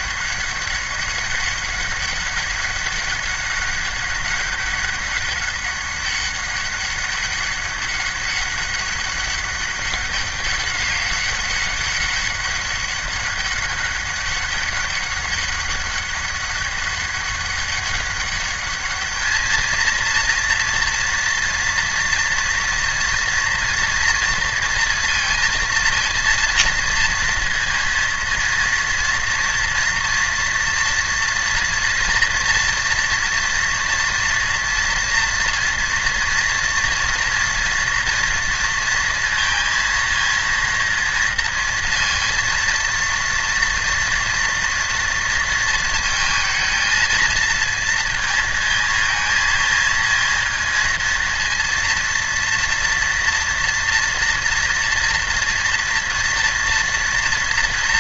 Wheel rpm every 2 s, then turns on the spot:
200, 200, 200, 200, 200, 200, 200, 190, 200, 200, 230, 230, 230, 230, 230, 230, 230, 230, 230, 230, 230, 230, 230, 230, 220, 230, 230, 230, 230.
none